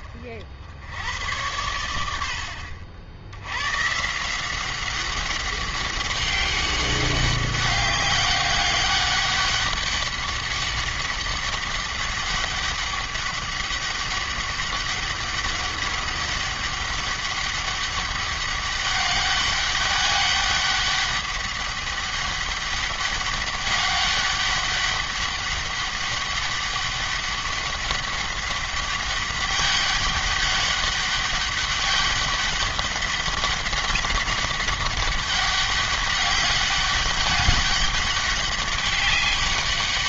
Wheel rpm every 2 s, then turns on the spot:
80, 60, 190, 200, 200, 200, 200, 200, 200, 200, 200, 200, 200, 200, 200, 200, 200, 200, 200, 200.
none